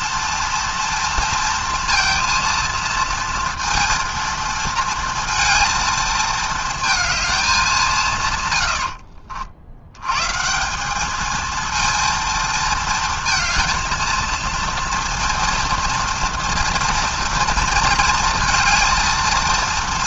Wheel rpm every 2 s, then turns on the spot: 230, 230, 230, 220, 100, 180, 230, 230, 230, 230.
none